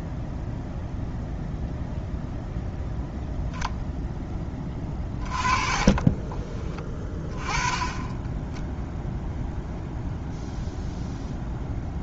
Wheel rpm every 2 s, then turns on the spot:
0, 0, 20, 20, 10, 0.
4-6